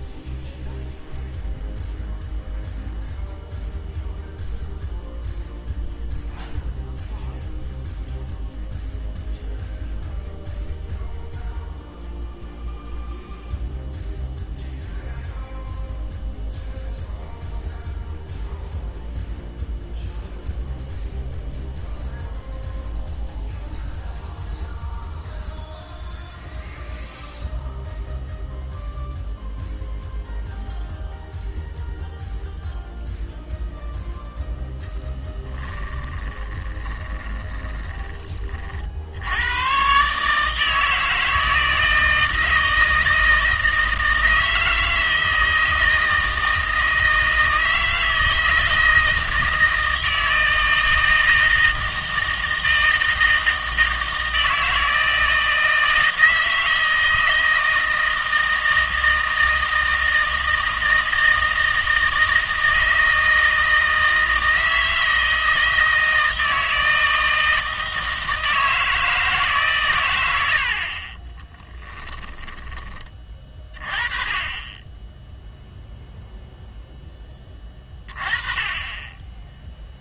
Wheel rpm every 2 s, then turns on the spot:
0, 0, 0, 0, 0, 0, 0, 0, 0, 0, 0, 0, 0, 0, 0, 0, 0, 0, 20, 60, 160, 160, 160, 160, 160, 160, 160, 160, 160, 160, 160, 160, 160, 160, 160, 60, 20, 20, 0, 20.
36-38 72-74